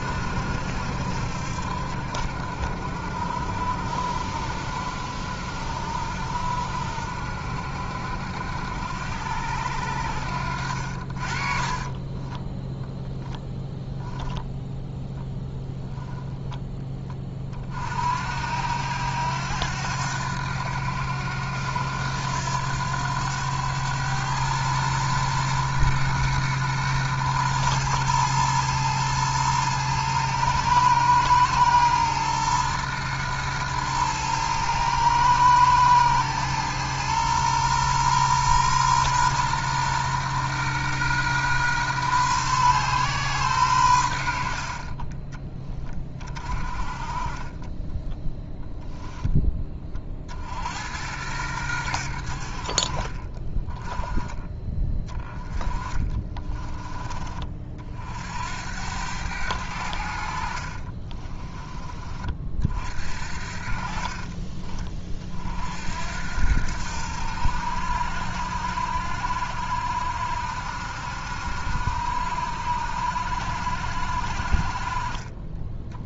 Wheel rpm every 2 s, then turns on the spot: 70, 60, 70, 70, 80, 60, 10, 10, 10, 80, 90, 90, 110, 110, 110, 110, 110, 110, 110, 120, 120, 130, 60, 30, 0, 80, 40, 20, 20, 90, 40, 50, 20, 80, 70, 70, 70, 40.
10-12 14-16 60-62